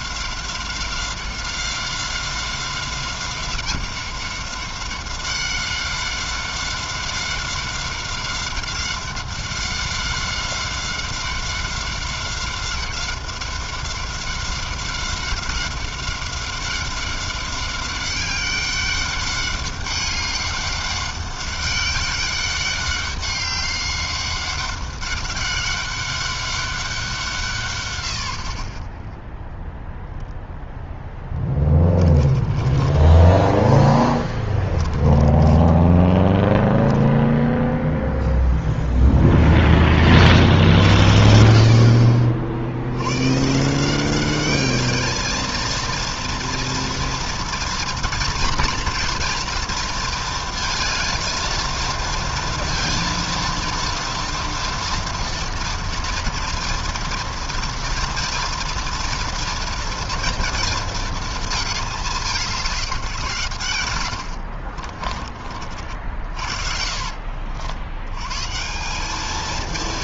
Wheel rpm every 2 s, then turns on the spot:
190, 190, 190, 190, 190, 190, 190, 190, 190, 200, 200, 200, 200, 160, 0, 10, 10, 20, 0, 0, 60, 130, 220, 230, 230, 220, 230, 230, 230, 230, 220, 140, 50, 70, 210.
30-32 34-36